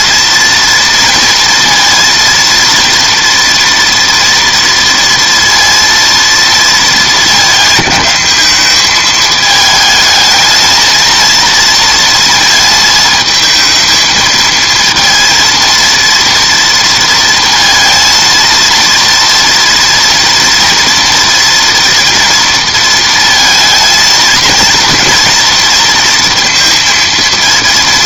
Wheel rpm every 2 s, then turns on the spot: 230, 230, 230, 230, 210, 220, 220, 230, 230, 230, 230, 230, 220, 230.
none